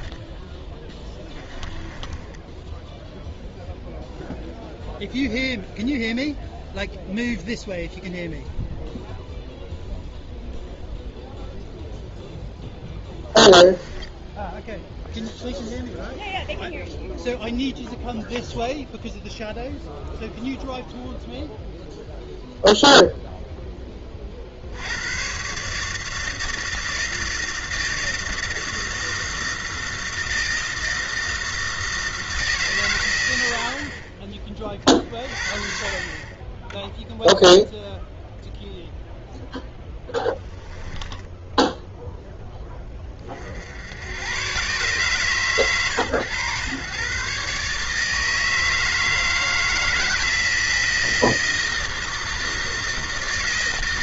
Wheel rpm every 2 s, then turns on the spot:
10, 0, 0, 0, 0, 0, 10, 0, 0, 0, 0, 0, 80, 160, 160, 160, 130, 40, 10, 0, 10, 10, 130, 120, 160, 160, 160.
0-2 12-14 40-42